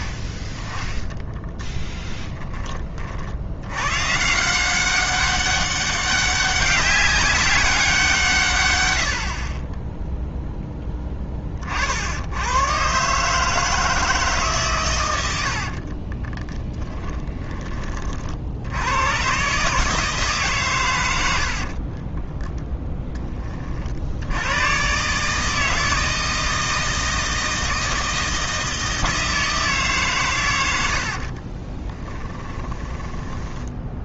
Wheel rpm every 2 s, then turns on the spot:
10, 20, 180, 200, 110, 10, 110, 130, 20, 80, 130, 20, 120, 160, 160, 90, 20.
16-18 22-24 32-34